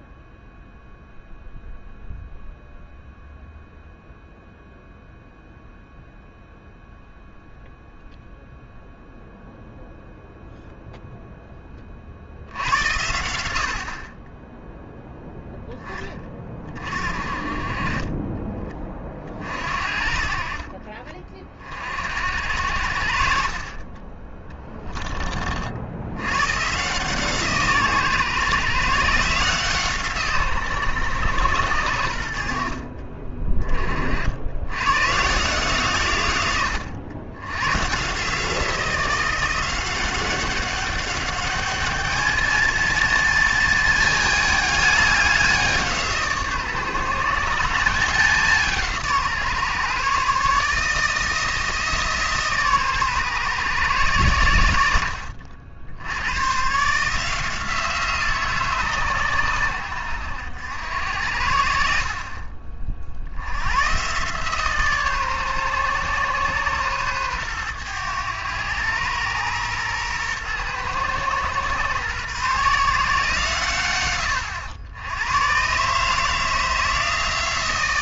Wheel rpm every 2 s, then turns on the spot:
0, 0, 0, 0, 0, 0, 80, 10, 40, 20, 40, 70, 20, 130, 130, 130, 60, 90, 100, 170, 200, 230, 210, 150, 170, 150, 140, 80, 130, 150, 90, 40, 140, 130, 100, 120, 140, 90, 160.
none